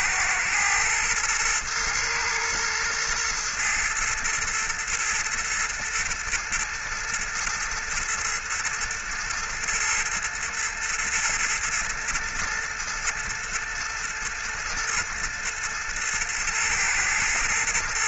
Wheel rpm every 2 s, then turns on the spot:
120, 120, 110, 120, 110, 110, 120, 110, 120.
none